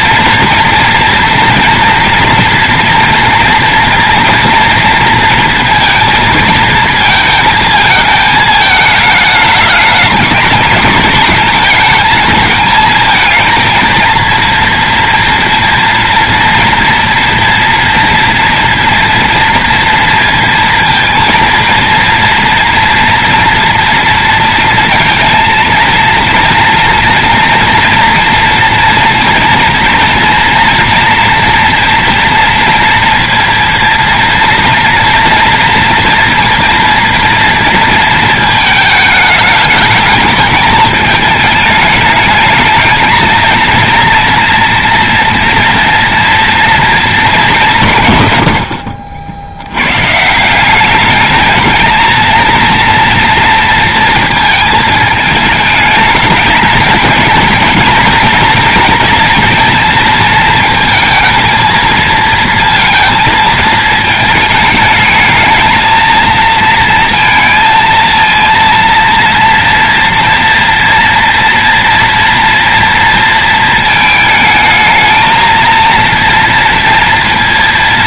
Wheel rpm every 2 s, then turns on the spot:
240, 230, 230, 220, 220, 220, 220, 230, 230, 230, 230, 230, 230, 230, 230, 230, 230, 230, 230, 220, 220, 220, 230, 230, 90, 190, 230, 230, 210, 230, 220, 230, 220, 230, 230, 230, 230, 220, 230.
none